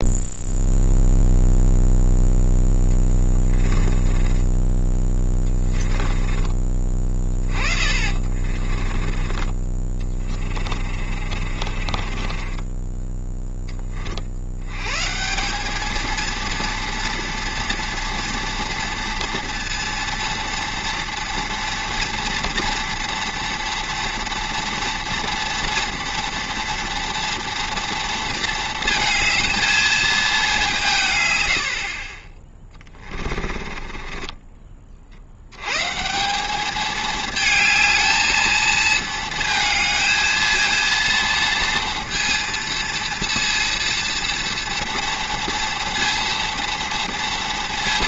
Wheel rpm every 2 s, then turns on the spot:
0, 10, 10, 30, 30, 30, 20, 100, 230, 230, 230, 230, 230, 240, 230, 190, 20, 20, 200, 220, 230, 230, 230, 230.
4-14 32-34